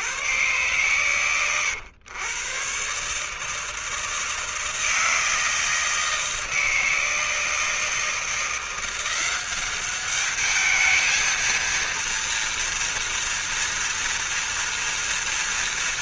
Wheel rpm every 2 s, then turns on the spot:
110, 110, 160, 160, 170, 200, 230, 230.
none